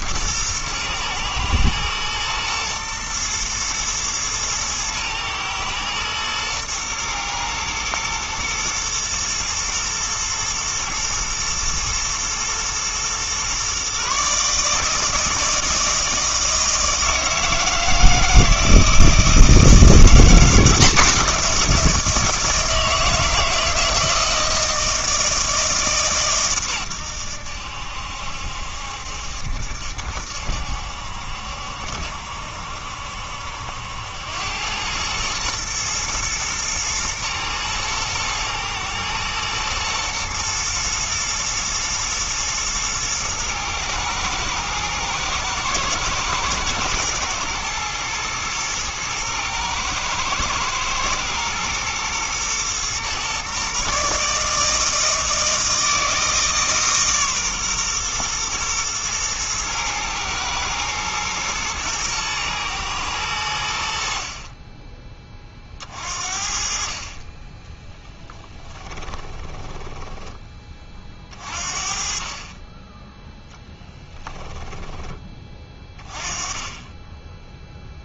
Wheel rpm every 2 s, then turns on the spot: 120, 120, 110, 110, 110, 120, 120, 150, 160, 160, 180, 160, 160, 110, 70, 70, 70, 100, 110, 110, 120, 110, 110, 110, 110, 110, 120, 160, 150, 120, 120, 110, 20, 40, 10, 30, 20, 10, 20.
68-70 74-76